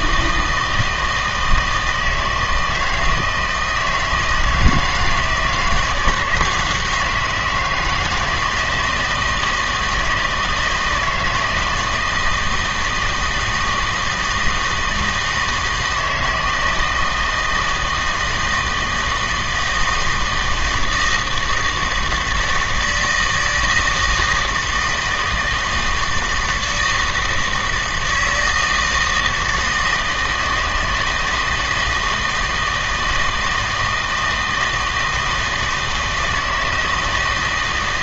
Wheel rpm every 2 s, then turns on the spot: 160, 160, 160, 170, 160, 160, 160, 160, 160, 160, 160, 160, 160, 160, 160, 160, 160, 160, 160.
none